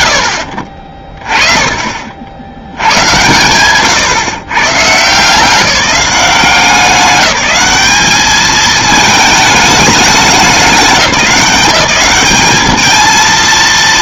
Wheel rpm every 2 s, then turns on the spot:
80, 100, 150, 180, 220, 200, 220.
none